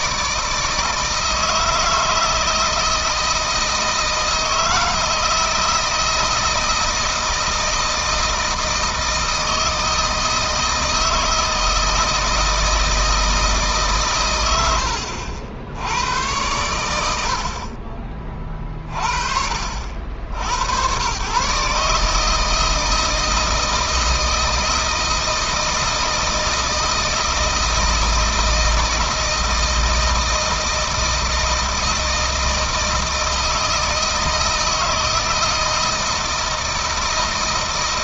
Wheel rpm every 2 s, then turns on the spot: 150, 160, 170, 160, 160, 160, 160, 90, 100, 40, 100, 160, 160, 160, 160, 160, 160, 160, 160.
none